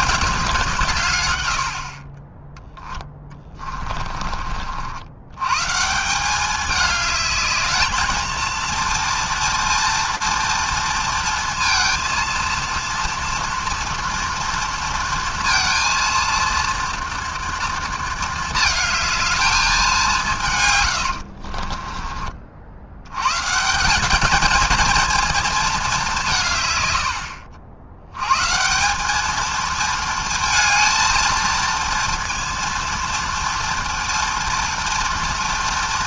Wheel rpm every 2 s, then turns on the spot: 190, 10, 50, 200, 230, 230, 230, 230, 230, 220, 160, 50, 220, 150, 140, 230, 230, 230.
none